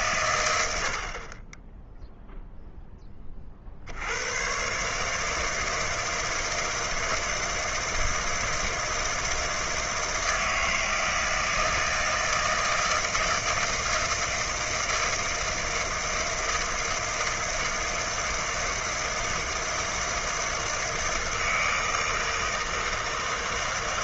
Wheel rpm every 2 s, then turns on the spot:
90, 0, 120, 160, 160, 160, 160, 160, 160, 160, 160, 160.
none